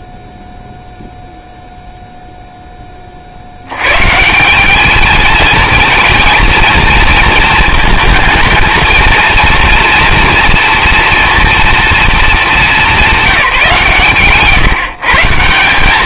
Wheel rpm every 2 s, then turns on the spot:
0, 0, 190, 230, 220, 230, 210, 130.
none